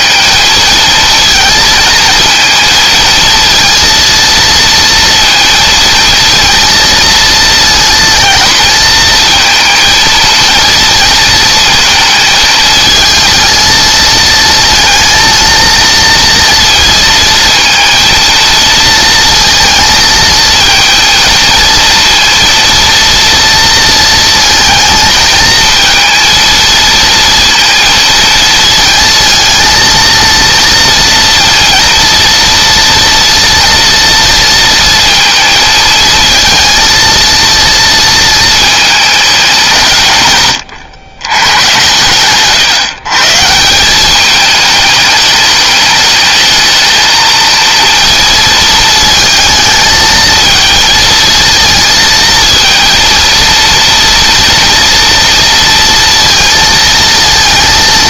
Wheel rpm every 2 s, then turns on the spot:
220, 230, 230, 230, 230, 230, 220, 230, 230, 230, 230, 230, 230, 230, 230, 230, 230, 230, 230, 210, 100, 140, 210, 230, 220, 220, 230, 230, 230.
none